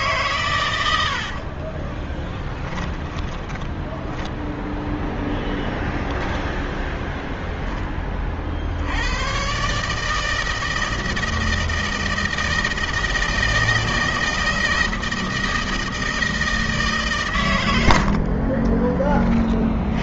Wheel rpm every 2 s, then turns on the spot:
110, 10, 0, 10, 60, 160, 160, 160, 150, 30.
0-2 18-20